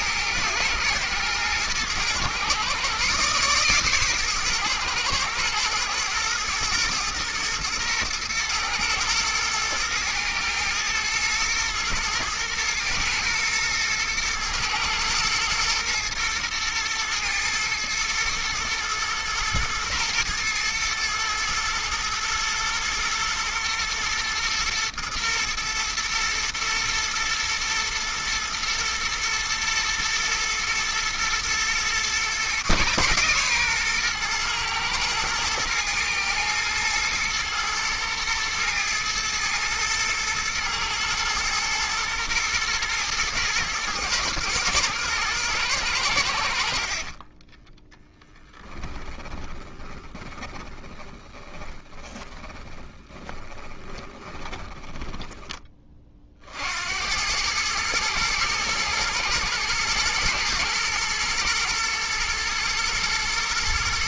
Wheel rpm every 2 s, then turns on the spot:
110, 120, 120, 110, 110, 110, 110, 120, 110, 110, 120, 110, 120, 110, 110, 110, 130, 110, 110, 110, 110, 120, 110, 80, 10, 30, 20, 10, 60, 110, 110, 110.
48-56